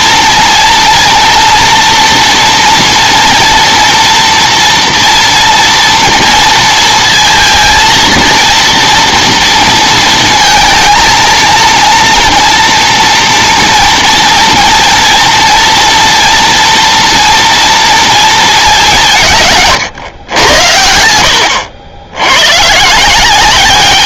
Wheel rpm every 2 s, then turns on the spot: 230, 240, 230, 230, 230, 230, 240, 230, 230, 210, 90, 120.
none